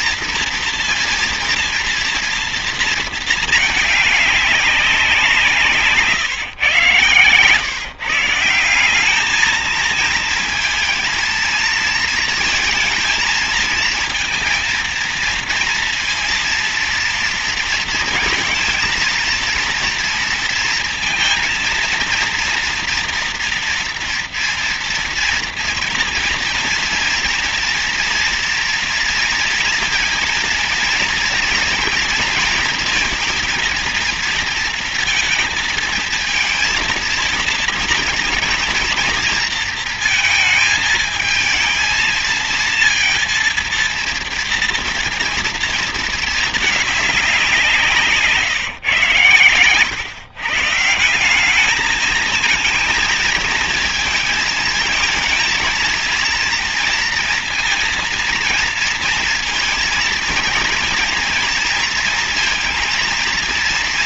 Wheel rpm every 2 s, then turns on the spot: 230, 230, 210, 130, 170, 230, 230, 230, 230, 230, 230, 230, 230, 230, 240, 230, 230, 230, 220, 230, 220, 230, 230, 220, 150, 140, 220, 230, 230, 230, 230, 230.
none